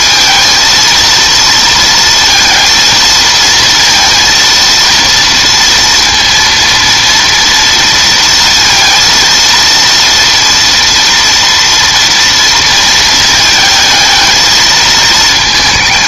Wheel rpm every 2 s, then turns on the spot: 230, 230, 230, 230, 230, 230, 230, 220.
none